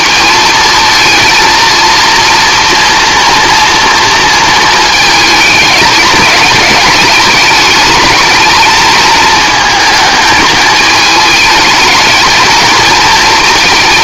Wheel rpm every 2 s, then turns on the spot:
230, 230, 220, 210, 220, 220, 220.
none